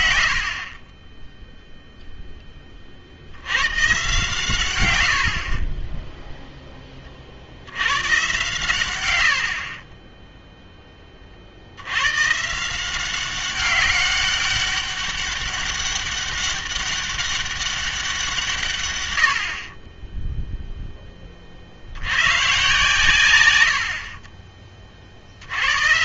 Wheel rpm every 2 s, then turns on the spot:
50, 30, 140, 0, 110, 0, 170, 200, 200, 150, 0, 130, 30.
none